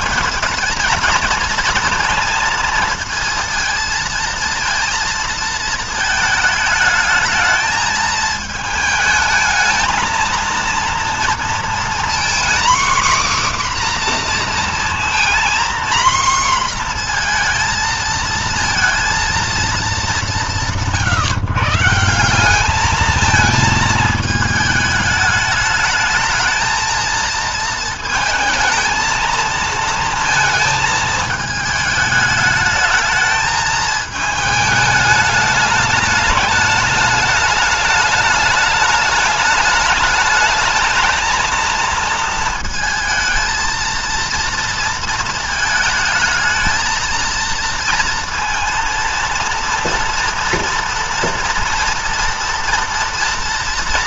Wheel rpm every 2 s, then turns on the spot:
220, 230, 230, 220, 220, 230, 250, 240, 240, 230, 150, 190, 220, 220, 220, 230, 210, 210, 220, 210, 220, 230, 230, 220, 230, 230, 230.
none